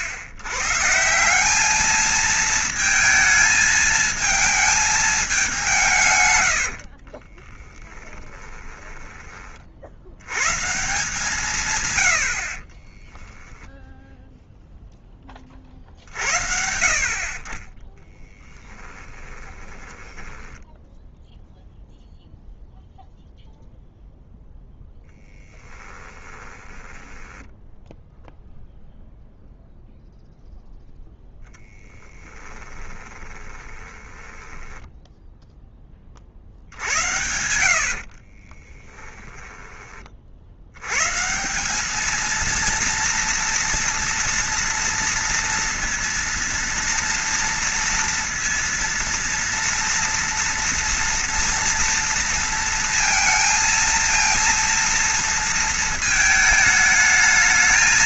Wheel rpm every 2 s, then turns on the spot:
110, 220, 220, 80, 10, 130, 50, 0, 70, 10, 10, 0, 0, 10, 0, 0, 20, 10, 70, 30, 80, 230, 230, 230, 230, 230, 230, 230, 220.
6-10 12-14 18-22 26-28 32-40